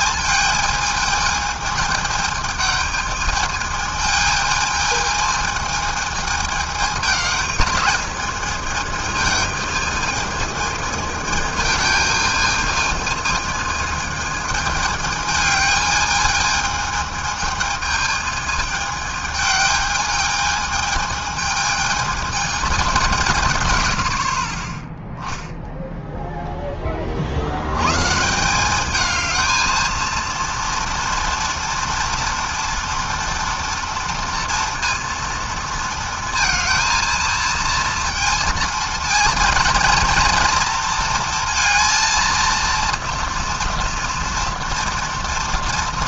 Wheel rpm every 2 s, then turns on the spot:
220, 220, 220, 210, 220, 220, 220, 210, 220, 210, 220, 160, 0, 60, 220, 230, 240, 230, 230, 230, 230, 230, 230.
none